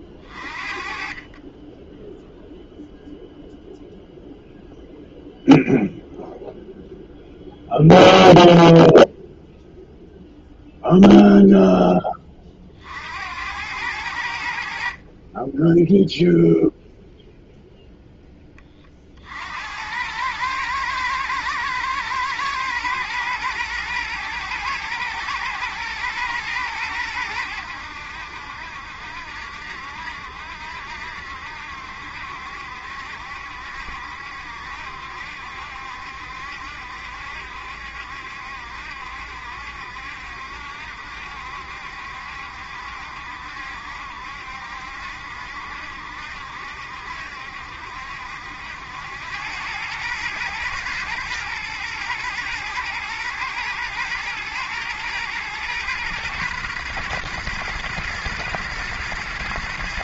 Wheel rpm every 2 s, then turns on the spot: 40, 0, 0, 0, 0, 0, 40, 70, 0, 20, 110, 120, 110, 110, 70, 70, 70, 70, 70, 70, 70, 70, 70, 70, 70, 110, 110, 110, 120, 120.
none